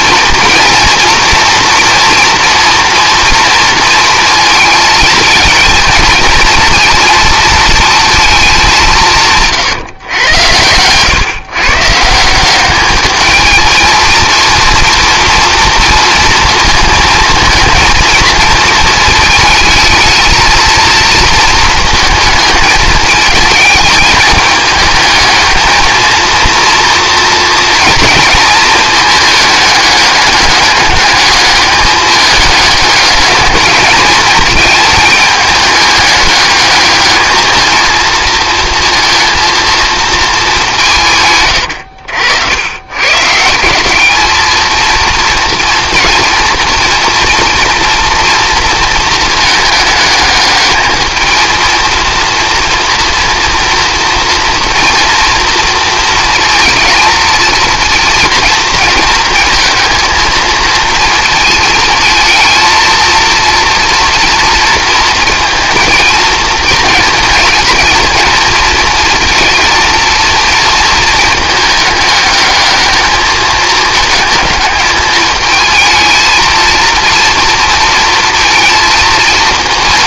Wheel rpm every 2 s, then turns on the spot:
230, 240, 230, 230, 190, 110, 200, 230, 230, 220, 230, 220, 220, 230, 220, 210, 210, 210, 210, 230, 180, 100, 220, 230, 230, 220, 230, 230, 220, 230, 230, 230, 230, 230, 230, 230, 210, 220, 230, 220.
10-12